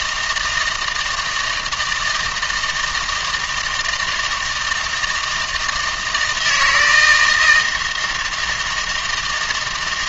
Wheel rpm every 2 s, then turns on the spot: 160, 160, 160, 160, 170.
none